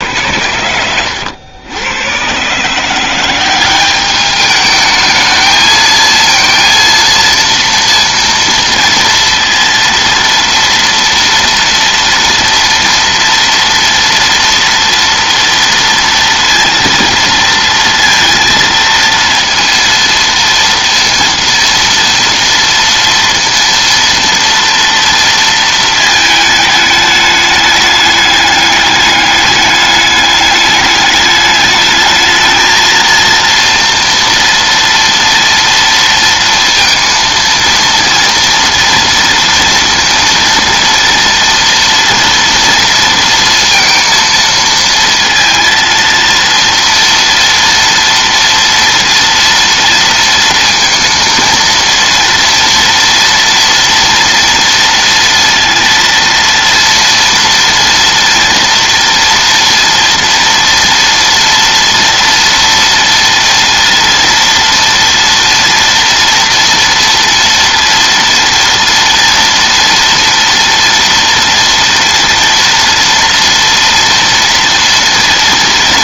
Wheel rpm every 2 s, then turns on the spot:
100, 160, 210, 230, 230, 230, 230, 230, 230, 230, 230, 230, 230, 210, 210, 210, 220, 230, 230, 230, 230, 230, 230, 230, 230, 230, 240, 230, 230, 240, 230, 240, 230, 230, 230, 230, 230, 230.
none